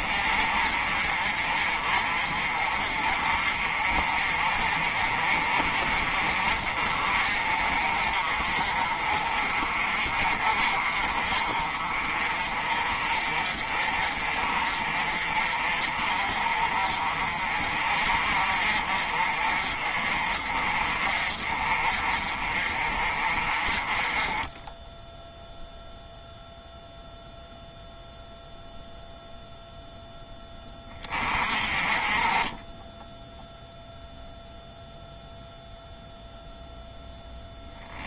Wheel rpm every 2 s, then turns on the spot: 40, 40, 40, 40, 40, 40, 40, 40, 40, 40, 40, 40, 10, 0, 0, 20, 10, 0, 0.
none